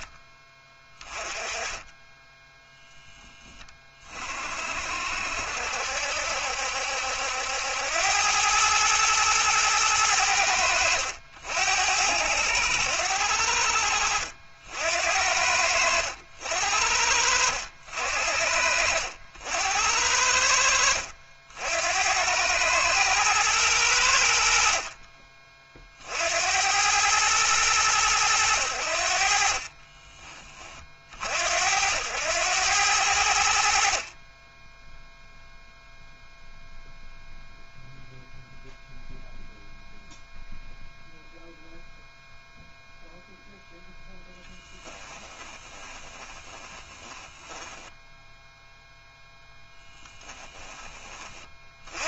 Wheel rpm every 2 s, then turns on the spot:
20, 0, 60, 70, 110, 80, 80, 70, 70, 60, 70, 110, 40, 100, 70, 40, 90, 0, 0, 0, 0, 0, 20, 20, 0, 20.
44-48